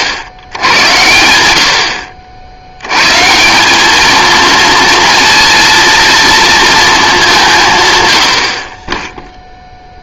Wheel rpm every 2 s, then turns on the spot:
90, 100, 230, 230, 30.
none